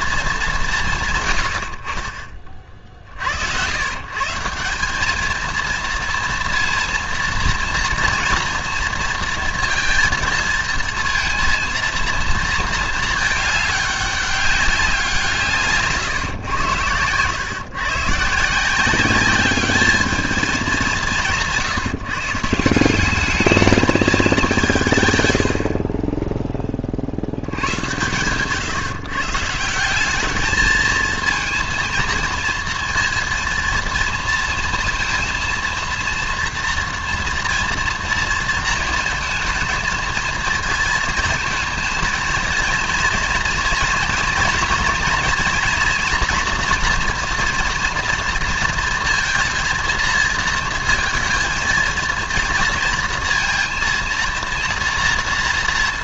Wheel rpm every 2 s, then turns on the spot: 170, 40, 190, 230, 230, 230, 230, 190, 110, 170, 190, 170, 180, 30, 140, 220, 230, 230, 230, 230, 230, 230, 230, 230, 230, 230, 230, 230.
none